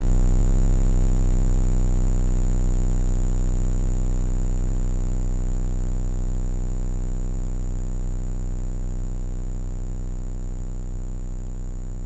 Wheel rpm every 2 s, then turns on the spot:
0, 0, 0, 0, 0, 0.
none